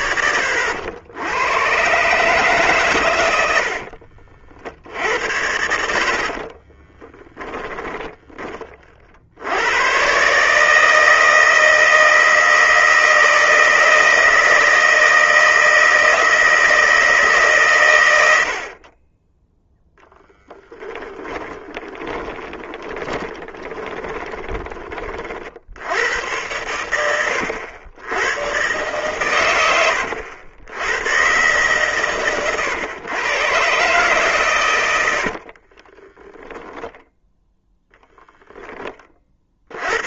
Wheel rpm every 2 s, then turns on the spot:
90, 120, 60, 20, 50, 160, 160, 160, 160, 40, 10, 10, 30, 90, 130, 110, 120, 90, 10, 20.
6-8 20-24 34-36